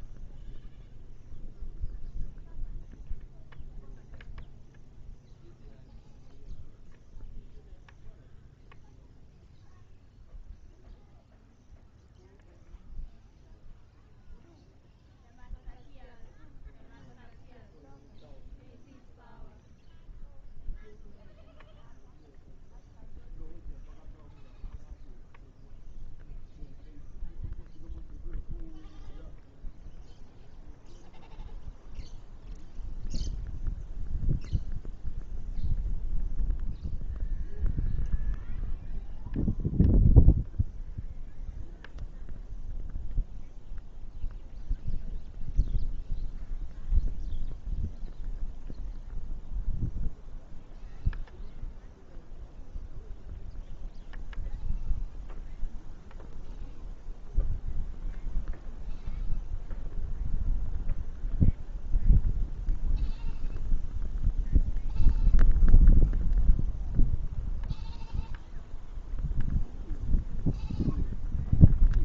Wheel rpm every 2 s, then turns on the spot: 0, 0, 0, 0, 0, 0, 0, 0, 0, 0, 0, 0, 0, 0, 0, 0, 0, 0, 0, 0, 0, 0, 0, 0, 0, 0, 0, 0, 0, 0, 0, 0, 0, 0, 0, 0.
none